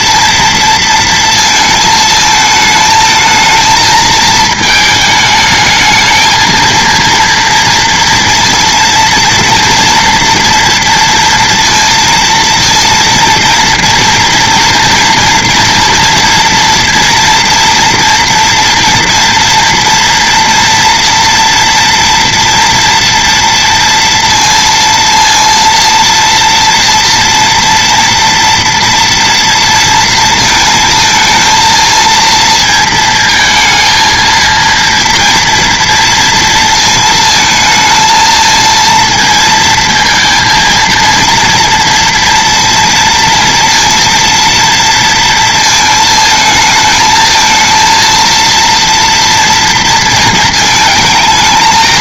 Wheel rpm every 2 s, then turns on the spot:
230, 220, 220, 230, 230, 230, 230, 230, 230, 240, 230, 240, 230, 230, 230, 220, 230, 230, 230, 220, 230, 230, 230, 220, 230, 230.
none